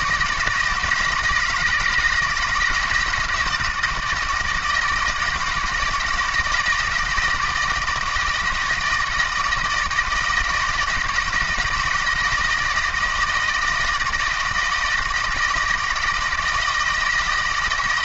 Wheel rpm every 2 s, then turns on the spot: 160, 160, 160, 160, 160, 170, 160, 160, 160.
none